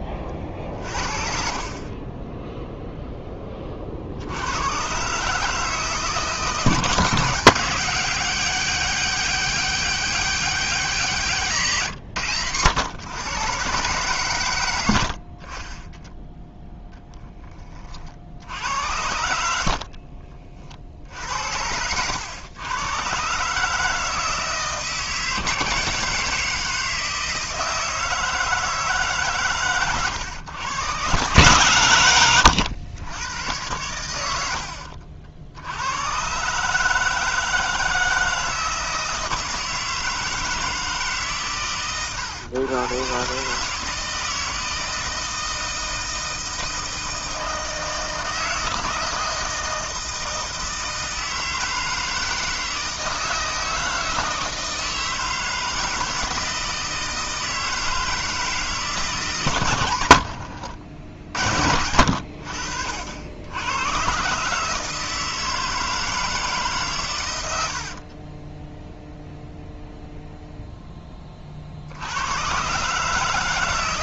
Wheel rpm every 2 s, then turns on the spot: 30, 0, 100, 160, 200, 200, 100, 110, 10, 70, 50, 110, 160, 170, 160, 110, 100, 80, 140, 160, 160, 110, 160, 160, 160, 160, 160, 160, 160, 160, 70, 70, 150, 150, 10, 0, 120.
34-36 60-62 68-70